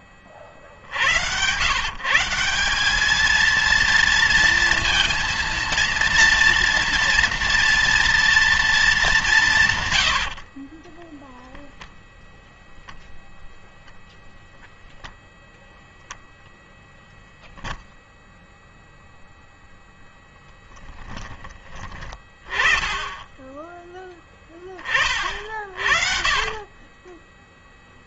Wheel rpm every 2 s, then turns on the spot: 50, 190, 230, 230, 220, 30, 0, 0, 0, 0, 0, 20, 20, 50.
26-28